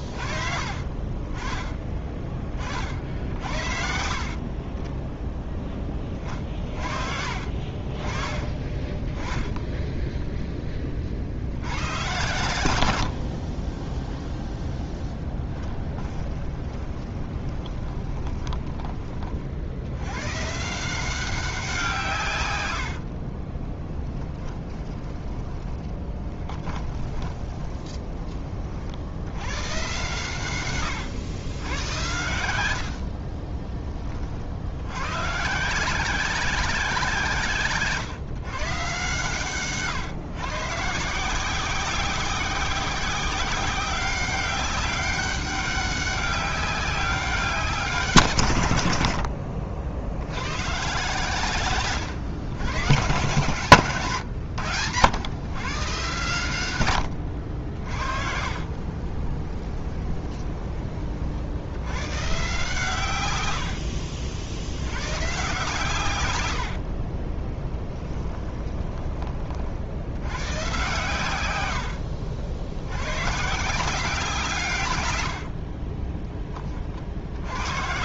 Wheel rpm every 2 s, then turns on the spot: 40, 50, 20, 40, 30, 20, 80, 0, 30, 20, 160, 90, 20, 20, 50, 120, 80, 90, 180, 140, 150, 190, 200, 190, 90, 120, 110, 100, 100, 40, 30, 130, 80, 70, 20, 130, 90, 140, 30.
8-10 16-18 22-28 30-34 58-60 66-70